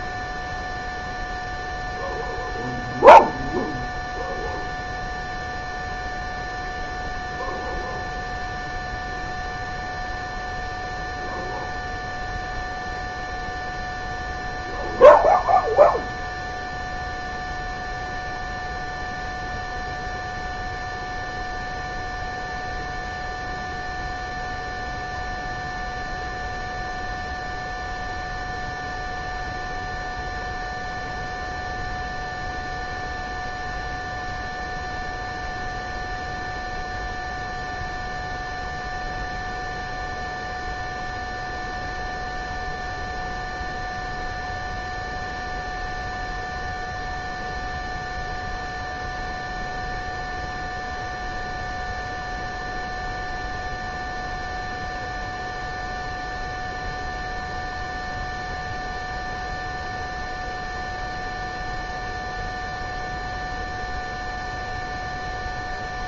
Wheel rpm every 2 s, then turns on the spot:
0, 0, 0, 0, 0, 0, 0, 0, 0, 0, 0, 0, 0, 0, 0, 0, 0, 0, 0, 0, 0, 0, 0, 0, 0, 0, 0, 0, 0, 0, 0, 0, 0.
none